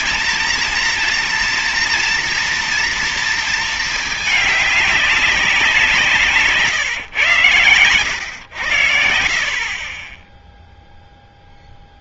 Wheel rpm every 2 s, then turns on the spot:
230, 230, 210, 150, 100, 10.
none